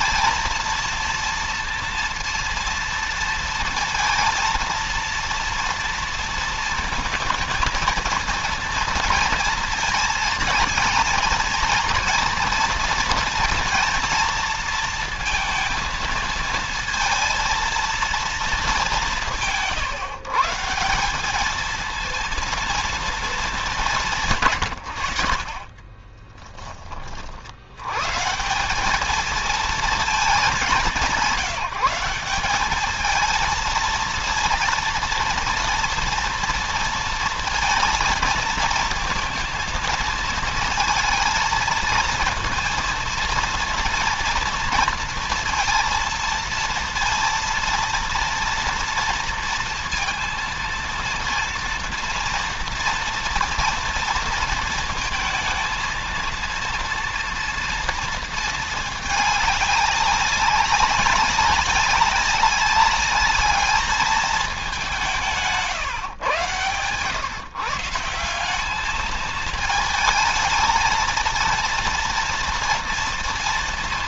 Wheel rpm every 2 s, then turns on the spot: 230, 230, 230, 230, 230, 230, 230, 220, 230, 200, 190, 230, 90, 30, 210, 200, 220, 230, 230, 230, 230, 230, 230, 230, 230, 230, 230, 230, 230, 220, 200, 200, 180, 130, 210, 230, 240.
none